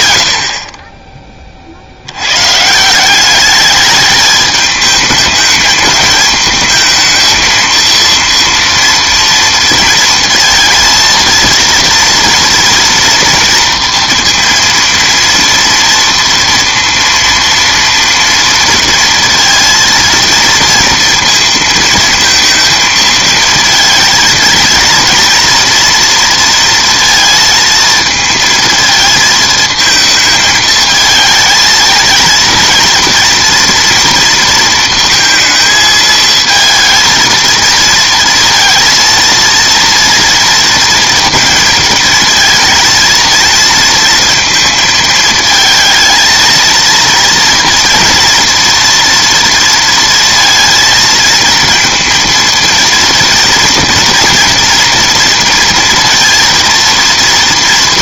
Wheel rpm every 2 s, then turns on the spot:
20, 190, 220, 230, 230, 230, 230, 230, 230, 230, 230, 220, 230, 230, 220, 220, 230, 230, 230, 230, 230, 230, 220, 230, 230, 230, 230, 230, 230.
none